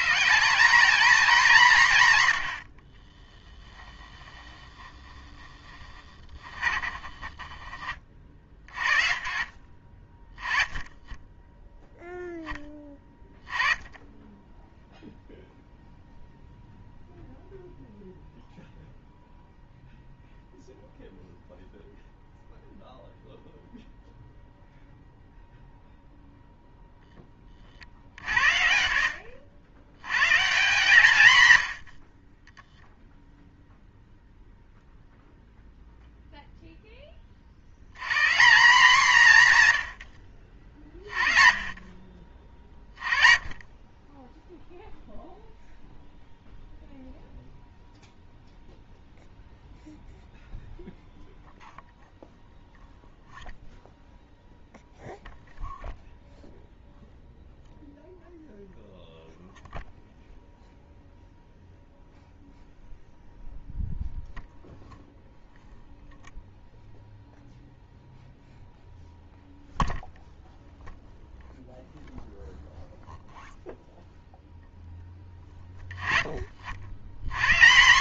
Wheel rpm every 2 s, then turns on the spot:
220, 60, 10, 30, 40, 20, 10, 10, 0, 0, 0, 0, 0, 0, 60, 160, 0, 0, 0, 180, 50, 30, 0, 0, 0, 0, 0, 0, 0, 0, 0, 0, 0, 0, 0, 0, 0, 0, 50.
4-8